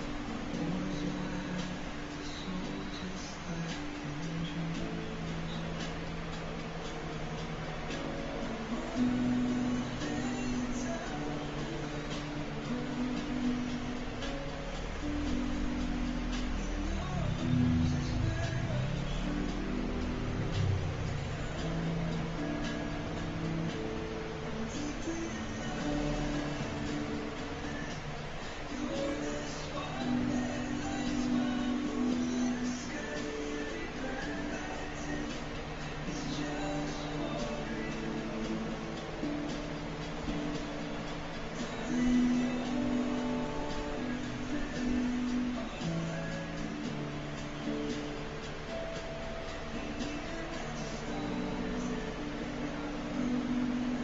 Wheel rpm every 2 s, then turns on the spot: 0, 0, 0, 0, 0, 0, 0, 0, 0, 0, 0, 0, 0, 0, 0, 0, 0, 0, 0, 0, 0, 0, 0, 0, 0, 0, 0.
none